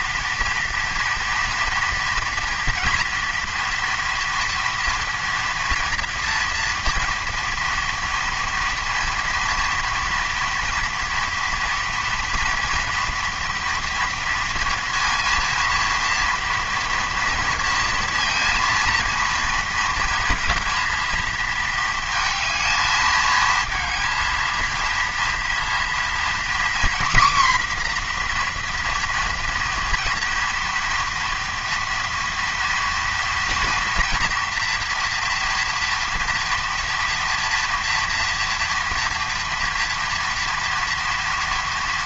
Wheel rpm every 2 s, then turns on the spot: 230, 230, 230, 230, 230, 230, 230, 230, 230, 230, 230, 220, 230, 250, 240, 240, 230, 230, 230, 240, 230.
none